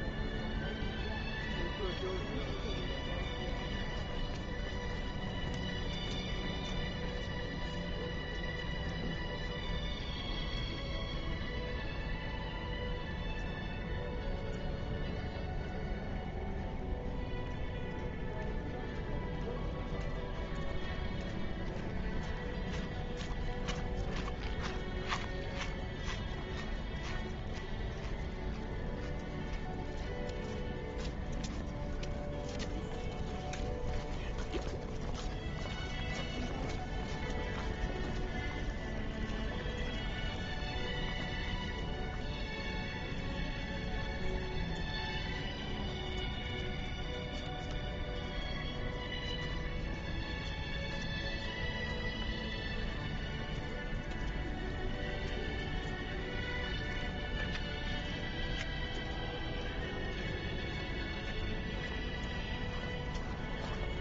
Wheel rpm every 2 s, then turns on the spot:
0, 0, 0, 0, 0, 0, 0, 0, 0, 0, 0, 0, 0, 0, 0, 0, 0, 0, 0, 0, 0, 0, 0, 0, 0, 0, 0, 0, 0, 0, 0, 0.
none